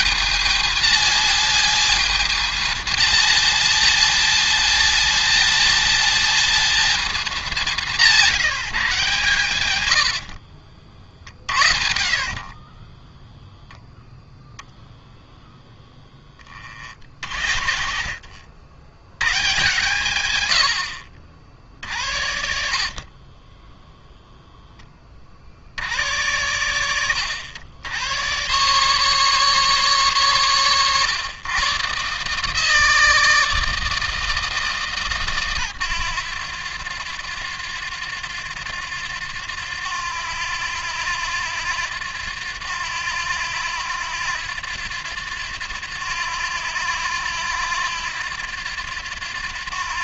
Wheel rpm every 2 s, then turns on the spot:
210, 220, 220, 230, 170, 40, 20, 0, 30, 90, 70, 50, 20, 80, 140, 130, 160, 140, 90, 90, 90, 90, 90, 90, 90.
10-14 22-24